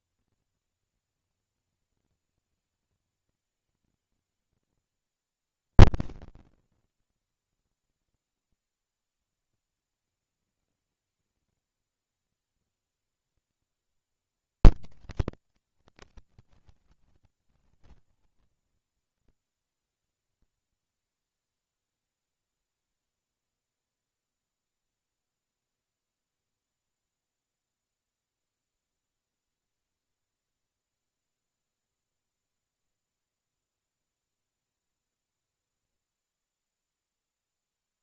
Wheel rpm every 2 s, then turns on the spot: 230, 210, 60, 30, 50, 110, 80, 70, 70, 70, 70, 40, 10, 10, 50, 70, 70, 50, 0.
4-8 24-26